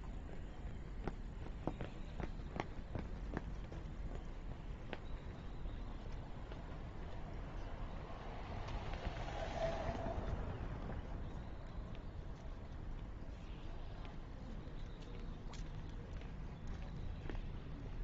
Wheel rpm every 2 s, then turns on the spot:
0, 0, 0, 0, 0, 0, 0, 0, 0.
none